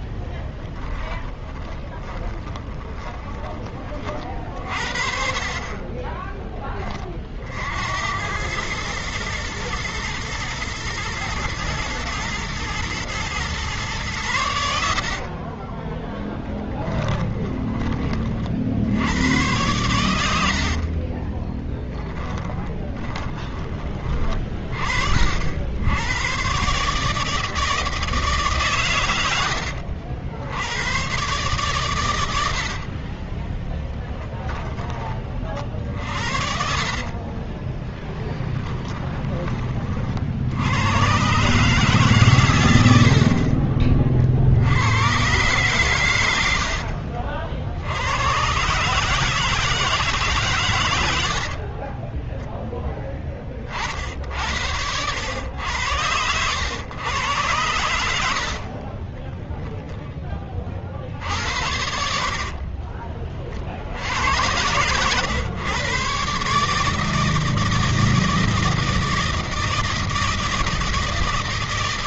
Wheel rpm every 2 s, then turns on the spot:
20, 20, 40, 20, 100, 110, 120, 80, 20, 60, 60, 20, 50, 130, 140, 100, 70, 20, 50, 20, 80, 100, 90, 70, 120, 120, 10, 80, 100, 70, 40, 30, 110, 150, 160, 160.
0-4 14-18 20-24 32-34 36-40 46-48 58-60 62-64